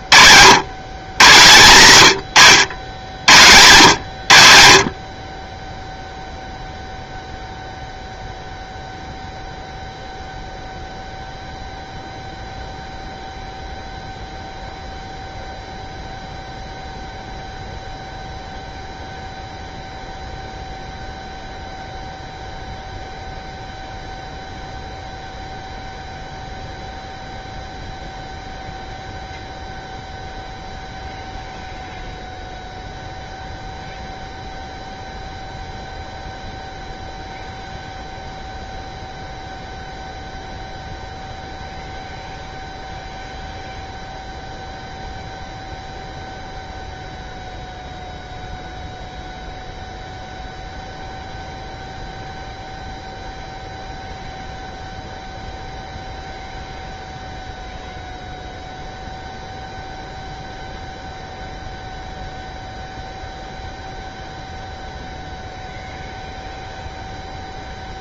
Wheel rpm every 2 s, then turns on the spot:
110, 90, 70, 0, 0, 0, 0, 0, 0, 0, 0, 0, 0, 0, 0, 0, 0, 0, 0, 0, 0, 0, 0, 0, 0, 0, 0, 0, 0, 0, 0, 0, 0, 0.
none